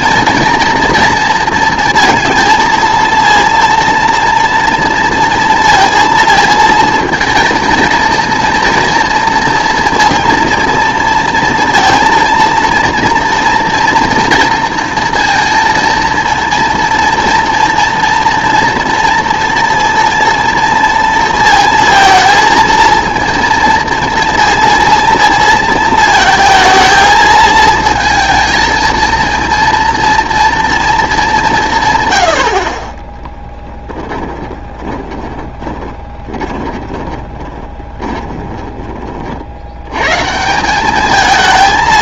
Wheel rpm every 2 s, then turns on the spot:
230, 230, 230, 220, 230, 230, 230, 230, 230, 230, 230, 230, 230, 230, 230, 230, 50, 20, 20, 20, 190.
34-38